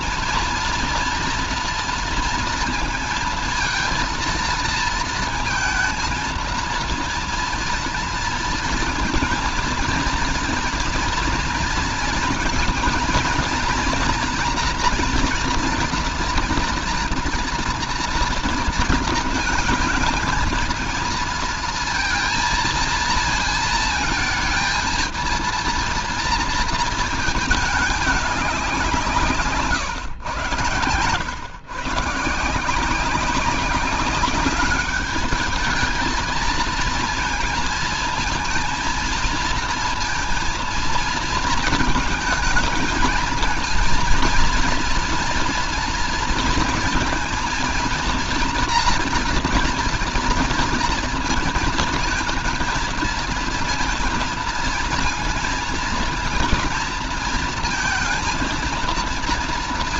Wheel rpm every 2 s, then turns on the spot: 230, 230, 230, 230, 230, 230, 230, 230, 230, 230, 220, 230, 220, 220, 200, 110, 160, 200, 220, 230, 230, 220, 230, 230, 240, 230, 230, 230, 220, 230.
none